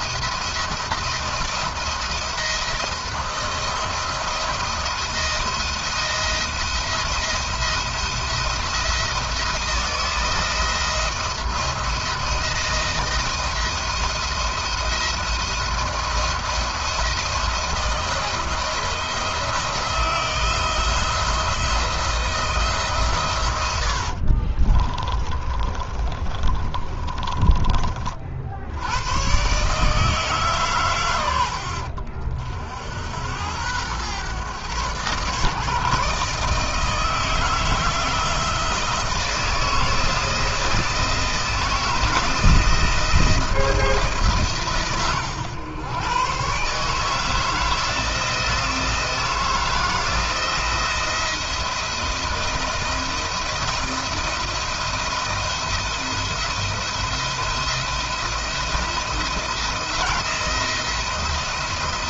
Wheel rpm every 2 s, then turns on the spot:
170, 170, 170, 170, 170, 160, 170, 170, 170, 170, 170, 150, 40, 20, 80, 130, 70, 120, 160, 160, 160, 170, 140, 150, 160, 170, 170, 170, 160, 170, 170.
24-28